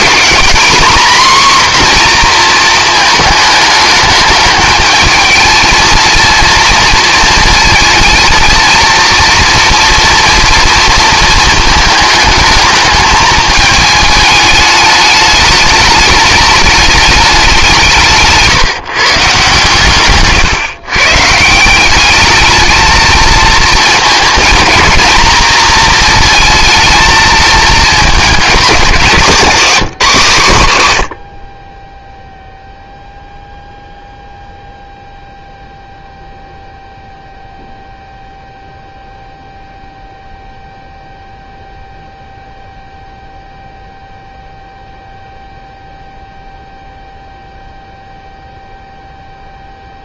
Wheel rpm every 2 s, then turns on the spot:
230, 230, 210, 230, 230, 230, 220, 210, 210, 130, 130, 220, 230, 220, 210, 140, 0, 0, 0, 0, 0, 0, 0, 0, 0.
none